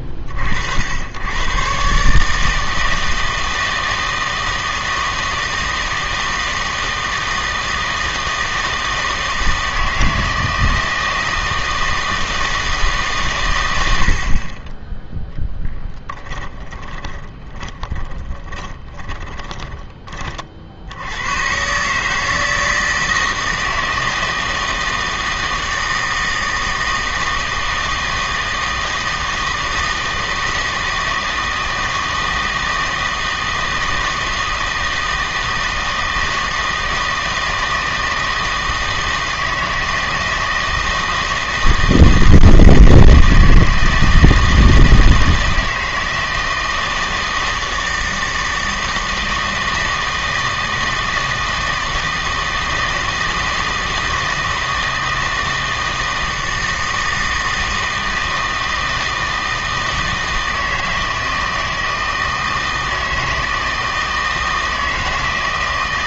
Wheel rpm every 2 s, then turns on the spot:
70, 160, 160, 160, 160, 160, 160, 20, 20, 30, 70, 160, 160, 160, 160, 160, 160, 160, 160, 160, 160, 160, 160, 160, 160, 160, 160, 160, 160, 160, 160, 160, 160.
16-20